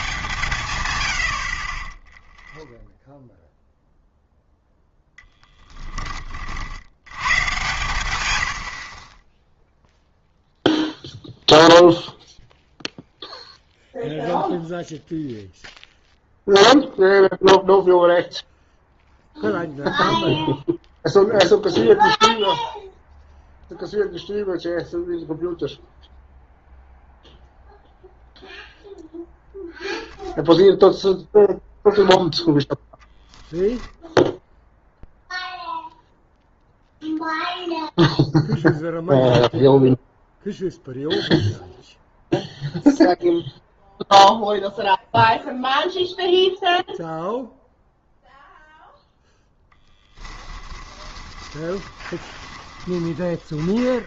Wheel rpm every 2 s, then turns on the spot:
110, 0, 0, 70, 40, 0, 0, 0, 0, 0, 0, 0, 0, 0, 0, 0, 10, 0, 0, 0, 0, 0, 0, 0, 0, 20, 20.
50-54